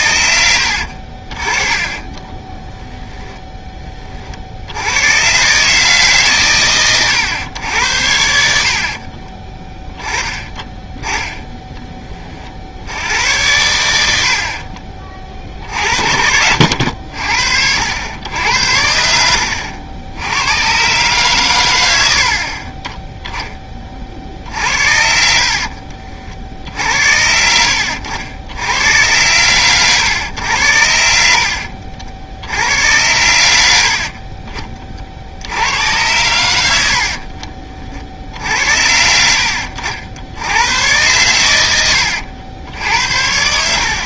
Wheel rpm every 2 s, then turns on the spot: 80, 20, 60, 130, 70, 10, 60, 50, 70, 90, 100, 40, 50, 60, 90, 90, 80, 30, 90, 80, 100, 80.
0-2